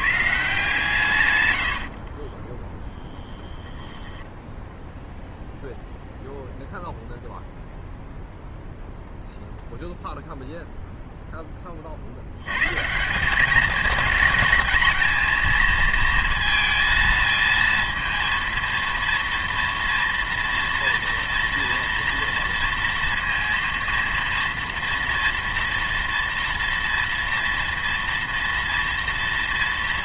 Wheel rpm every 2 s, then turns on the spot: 140, 10, 10, 0, 0, 0, 140, 220, 220, 230, 230, 230, 230, 230, 230.
2-4